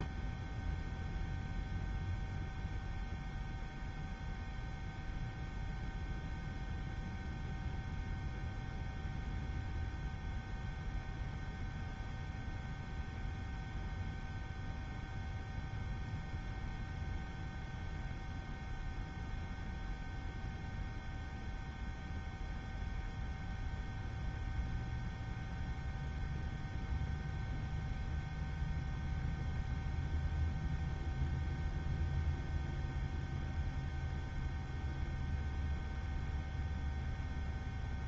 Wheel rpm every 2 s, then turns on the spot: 0, 0, 0, 0, 0, 0, 0, 0, 0, 0, 0, 0, 0, 0, 0, 0, 0, 0, 0.
none